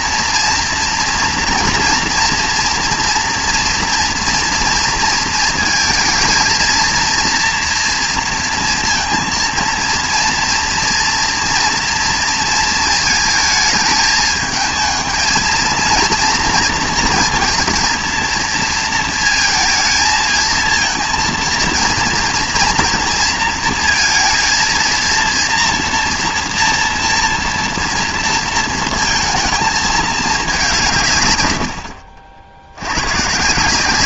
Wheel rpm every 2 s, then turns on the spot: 230, 230, 230, 230, 230, 230, 230, 220, 230, 230, 220, 230, 230, 240, 230, 180, 80.
none